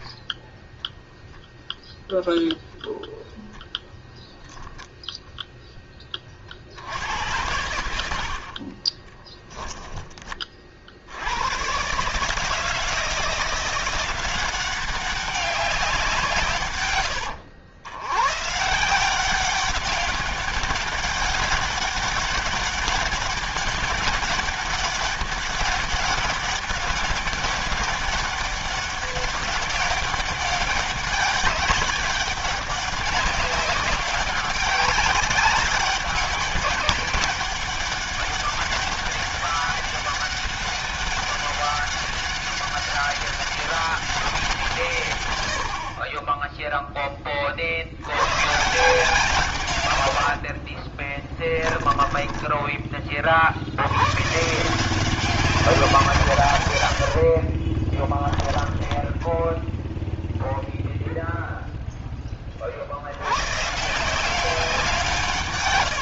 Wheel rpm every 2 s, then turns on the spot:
0, 0, 0, 70, 40, 50, 160, 190, 110, 160, 200, 200, 200, 200, 200, 200, 200, 190, 200, 200, 200, 200, 160, 10, 140, 50, 20, 160, 100, 10, 0, 50, 180.
8-10 50-52 56-60